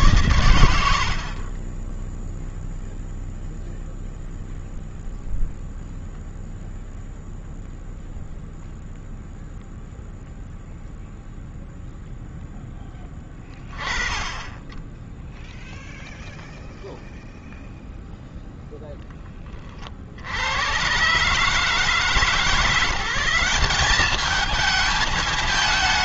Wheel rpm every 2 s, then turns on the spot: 80, 0, 0, 0, 0, 0, 10, 10, 0, 10, 110, 170, 220.
0-2